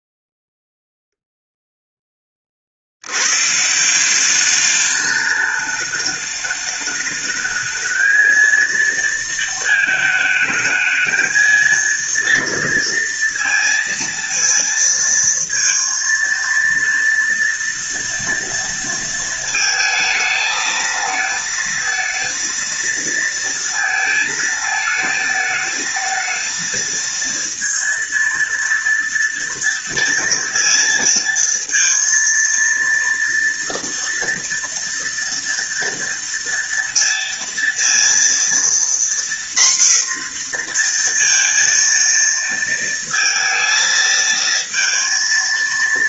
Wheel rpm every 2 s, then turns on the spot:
0, 70, 200, 210, 230, 220, 230, 230, 230, 230, 220, 230, 220, 230, 230, 230, 230, 230, 230, 240, 240, 230, 230.
none